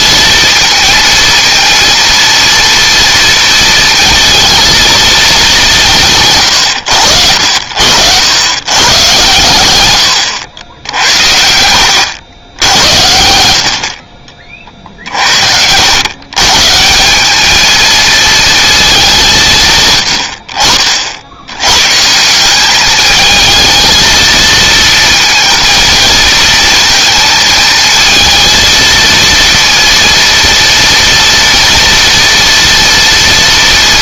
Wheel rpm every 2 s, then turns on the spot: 230, 230, 220, 110, 110, 80, 90, 40, 150, 220, 50, 200, 230, 230, 230, 230, 230.
none